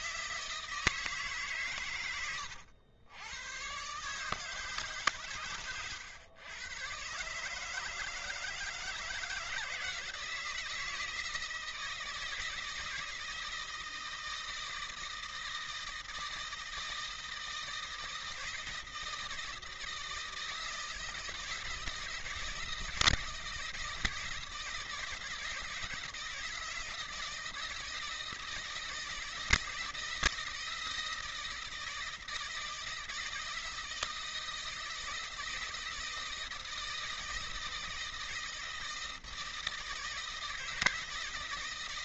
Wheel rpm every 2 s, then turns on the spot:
160, 100, 150, 120, 160, 160, 160, 160, 160, 160, 160, 160, 160, 160, 160, 170, 160, 160, 160, 160, 160.
none